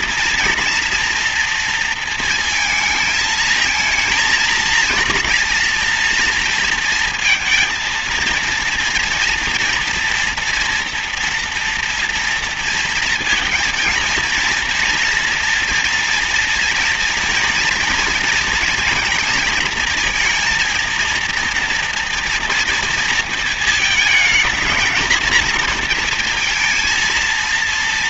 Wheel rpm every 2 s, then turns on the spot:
230, 220, 230, 230, 230, 240, 230, 230, 230, 230, 230, 230, 220, 230.
none